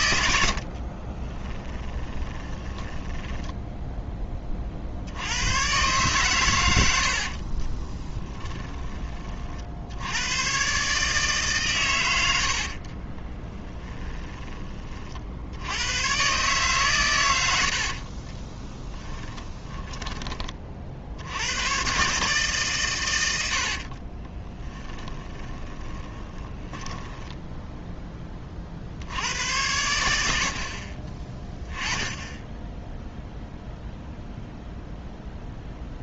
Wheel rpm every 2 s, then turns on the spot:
50, 10, 50, 100, 20, 140, 40, 30, 130, 20, 50, 130, 20, 10, 50, 40, 10, 0.
0-4 6-10 12-14 18-20 24-28